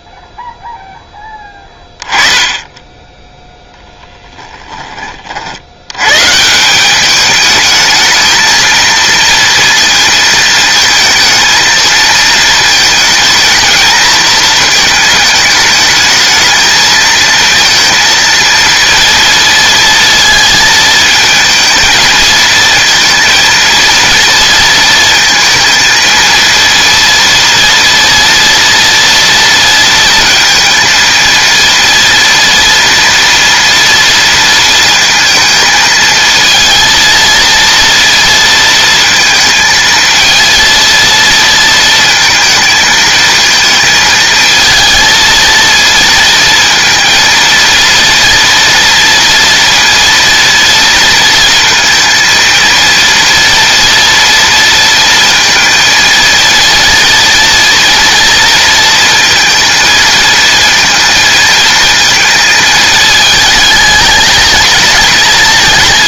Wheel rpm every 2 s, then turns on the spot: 0, 10, 10, 180, 230, 230, 220, 220, 220, 230, 220, 230, 230, 230, 230, 230, 230, 230, 230, 230, 230, 220, 220, 230, 230, 230, 230, 230, 230, 230, 220, 220, 220.
none